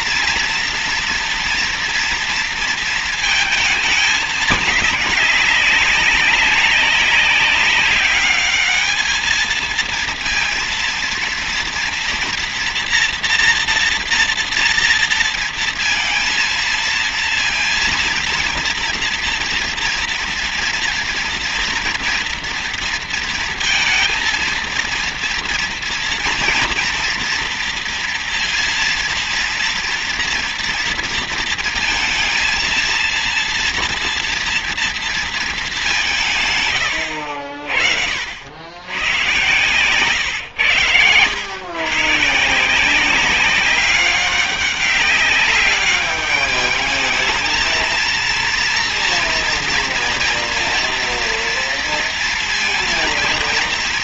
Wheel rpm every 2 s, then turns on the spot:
230, 230, 210, 190, 210, 230, 240, 230, 230, 230, 230, 230, 230, 230, 230, 230, 230, 230, 150, 90, 110, 160, 200, 210, 230, 240, 230.
none